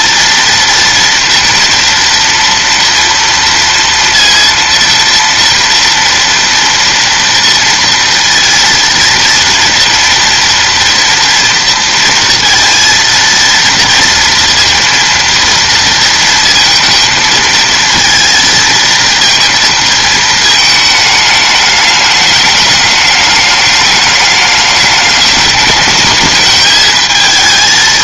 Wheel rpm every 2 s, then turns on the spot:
230, 230, 230, 230, 230, 230, 230, 230, 230, 220, 220, 210, 210, 220.
none